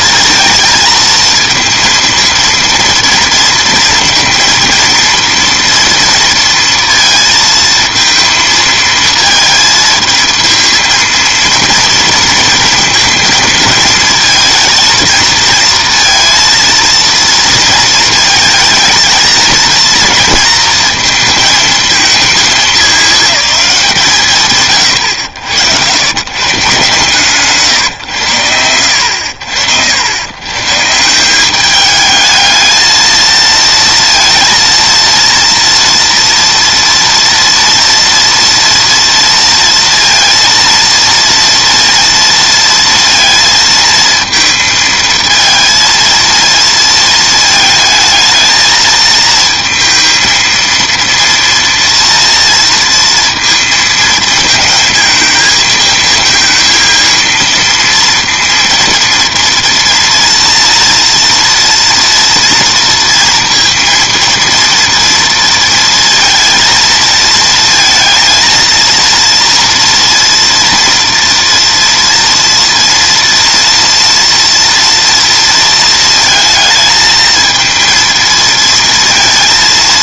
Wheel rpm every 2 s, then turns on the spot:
230, 230, 230, 230, 220, 220, 230, 230, 230, 230, 230, 210, 120, 130, 90, 130, 220, 230, 230, 230, 230, 230, 230, 230, 220, 230, 230, 220, 230, 230, 230, 230, 230, 230, 230, 230, 230, 230, 220, 230.
none